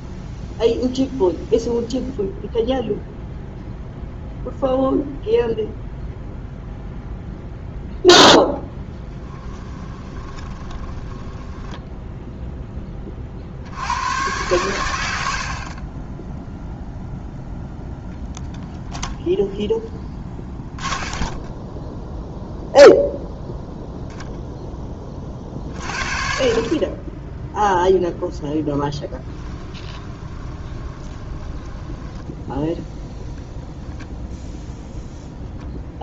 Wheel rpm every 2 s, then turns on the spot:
0, 0, 0, 0, 10, 10, 20, 100, 0, 0, 20, 0, 10, 30, 10, 20, 0, 0.
8-12 20-22 28-32